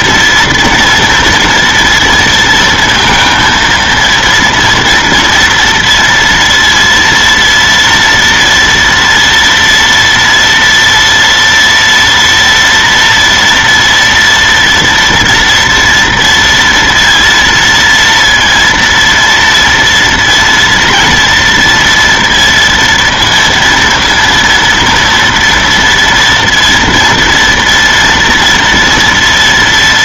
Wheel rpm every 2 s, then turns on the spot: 230, 230, 240, 230, 230, 230, 230, 230, 230, 230, 240, 230, 230, 230, 240.
none